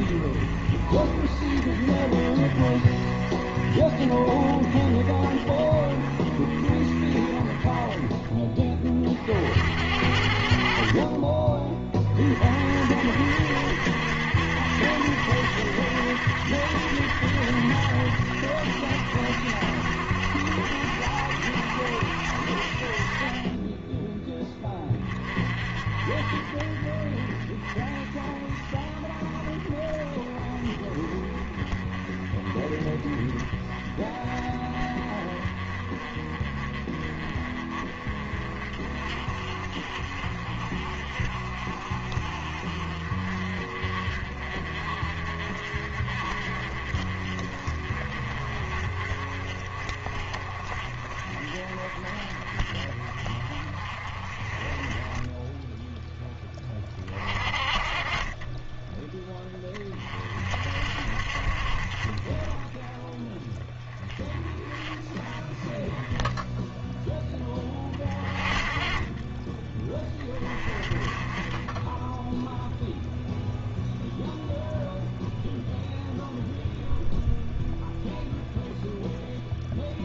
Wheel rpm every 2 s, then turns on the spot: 40, 40, 30, 40, 30, 50, 60, 80, 80, 70, 70, 50, 20, 40, 30, 30, 30, 30, 30, 40, 40, 40, 40, 40, 40, 40, 40, 20, 30, 10, 50, 20, 20, 10, 20, 30, 0, 0, 0, 0.
none